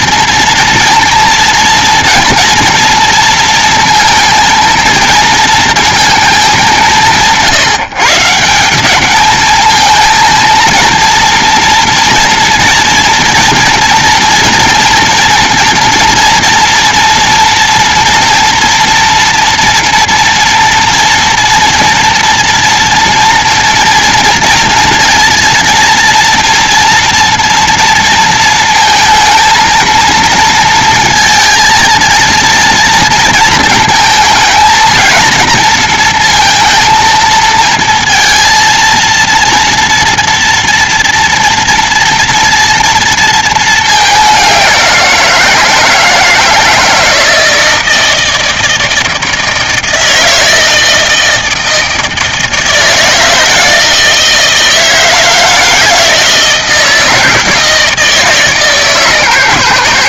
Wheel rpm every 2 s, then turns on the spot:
230, 230, 230, 180, 170, 230, 230, 240, 230, 230, 230, 230, 240, 230, 230, 230, 230, 220, 230, 230, 230, 230, 190, 160, 160, 160, 160, 170, 160, 150.
none